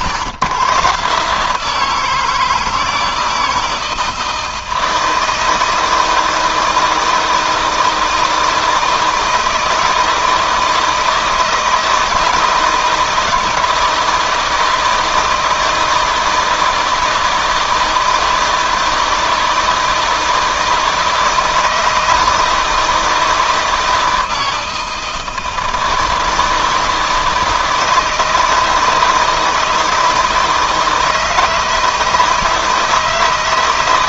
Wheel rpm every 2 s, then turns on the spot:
130, 160, 160, 160, 160, 160, 160, 160, 160, 160, 160, 160, 160, 160, 160, 160, 160.
none